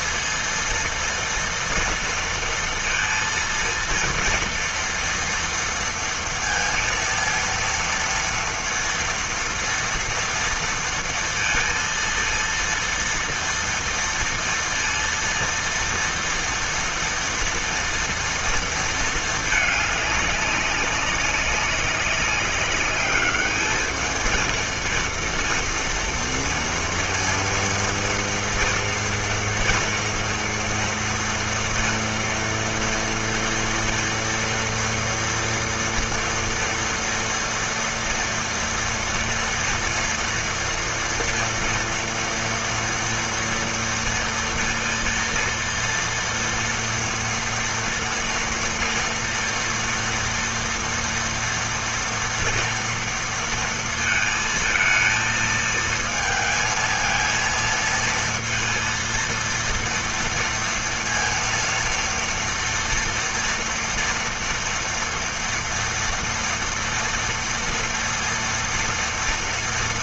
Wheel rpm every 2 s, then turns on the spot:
230, 230, 230, 230, 230, 230, 230, 230, 230, 230, 200, 200, 230, 230, 230, 230, 230, 230, 230, 230, 230, 230, 230, 230, 230, 230, 230, 230, 220, 230, 230, 230, 230, 230, 230.
none